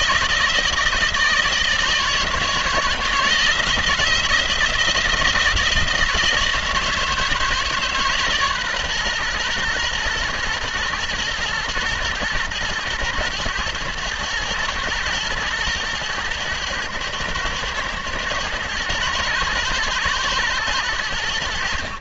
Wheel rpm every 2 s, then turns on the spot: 160, 160, 160, 170, 140, 120, 110, 120, 110, 110, 110.
none